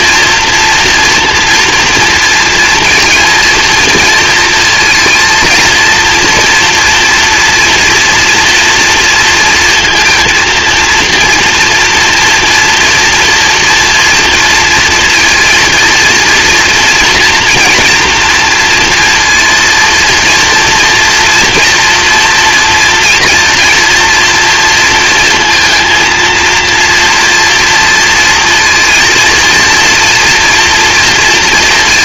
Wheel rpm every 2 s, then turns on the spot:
230, 230, 230, 240, 230, 230, 230, 230, 230, 230, 230, 230, 230, 230, 230, 230.
none